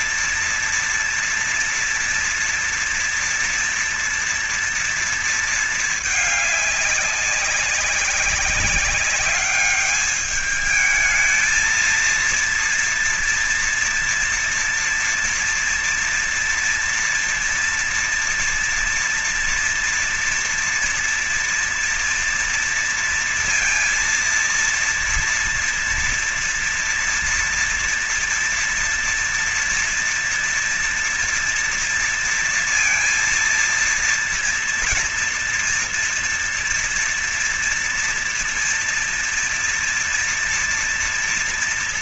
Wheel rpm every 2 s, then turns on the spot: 230, 230, 230, 210, 200, 210, 230, 230, 230, 230, 230, 230, 230, 240, 230, 230, 230, 230, 230, 230, 240.
none